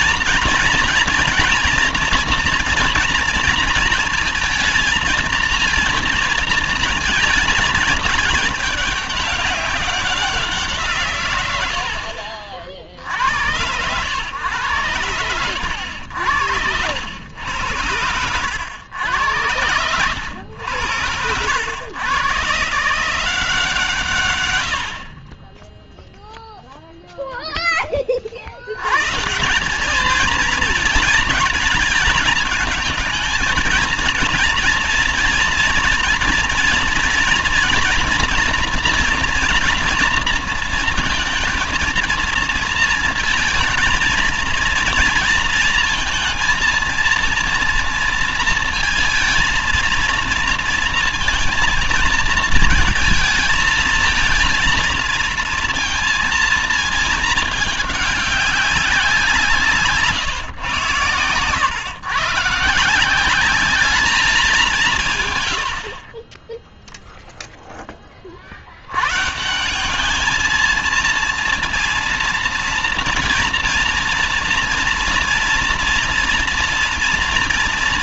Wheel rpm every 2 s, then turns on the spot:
240, 240, 230, 220, 200, 150, 70, 100, 90, 100, 90, 160, 70, 0, 110, 220, 220, 230, 240, 240, 230, 230, 230, 230, 230, 230, 220, 220, 230, 190, 120, 160, 160, 0, 100, 230, 230, 230, 230.
none